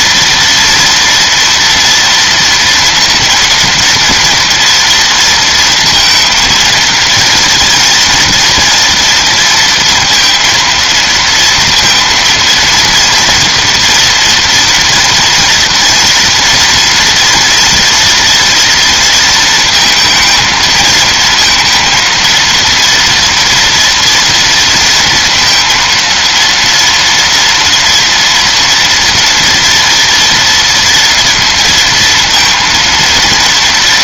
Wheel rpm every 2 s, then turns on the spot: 230, 230, 230, 230, 230, 230, 230, 240, 230, 230, 220, 230, 230, 230, 240, 230, 230.
none